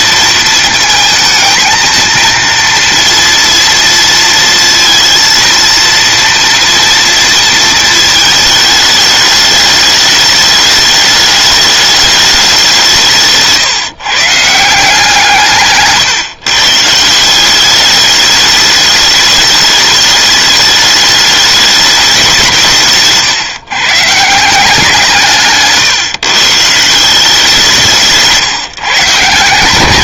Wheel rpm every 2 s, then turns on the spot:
220, 230, 230, 230, 220, 210, 180, 160, 150, 210, 210, 150, 170, 160, 140.
none